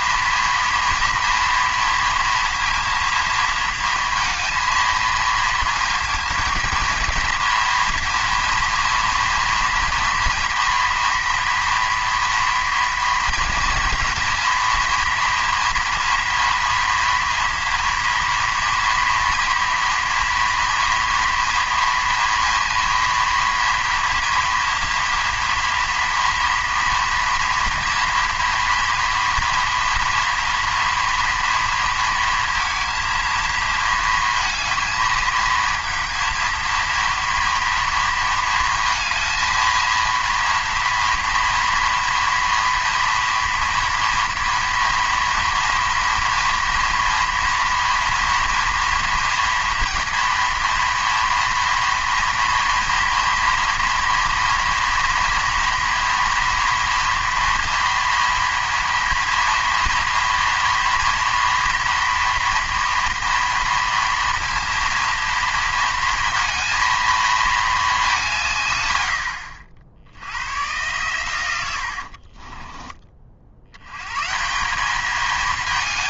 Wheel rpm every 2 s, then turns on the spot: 230, 230, 230, 230, 230, 230, 240, 230, 230, 230, 230, 230, 230, 230, 240, 230, 230, 220, 230, 220, 230, 230, 230, 230, 230, 230, 230, 230, 230, 230, 230, 230, 230, 220, 140, 110, 20, 180.
72-74